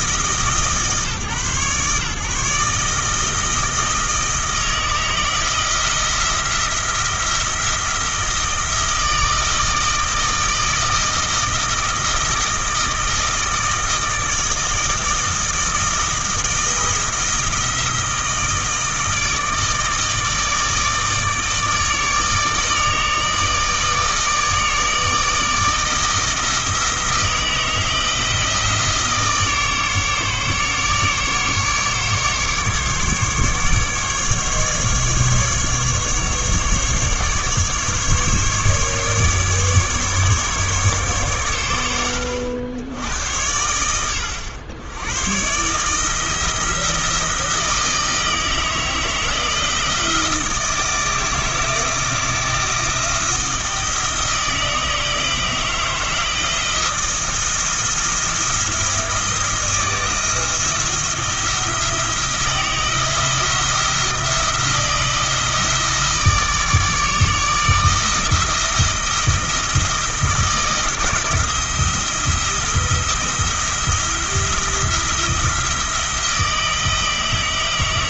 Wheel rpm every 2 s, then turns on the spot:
150, 150, 160, 170, 160, 160, 160, 160, 170, 160, 160, 150, 160, 160, 160, 150, 150, 150, 150, 150, 140, 80, 100, 170, 160, 160, 160, 160, 160, 170, 170, 160, 170, 160, 160, 160, 170, 170, 160.
none